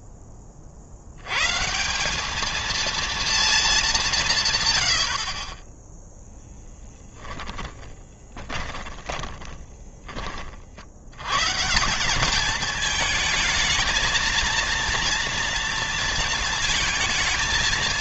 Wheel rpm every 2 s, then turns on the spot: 70, 230, 30, 10, 30, 80, 220, 230, 220.
8-10